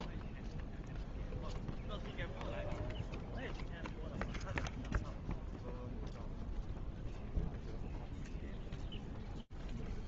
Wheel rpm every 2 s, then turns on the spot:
0, 0, 0, 0, 0.
none